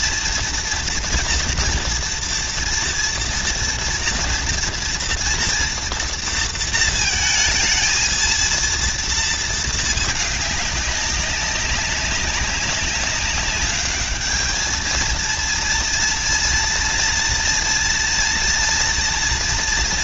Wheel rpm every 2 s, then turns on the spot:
230, 230, 230, 230, 230, 200, 200, 220, 230, 230.
none